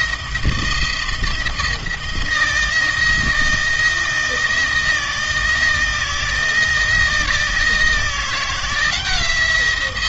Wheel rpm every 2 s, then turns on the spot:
170, 170, 160, 170, 170.
none